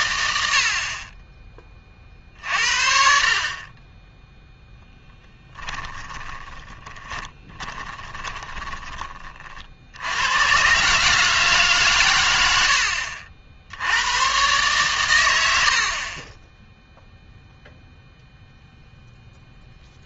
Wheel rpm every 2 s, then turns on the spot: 60, 60, 10, 20, 20, 130, 70, 130, 0, 0.
6-8 12-14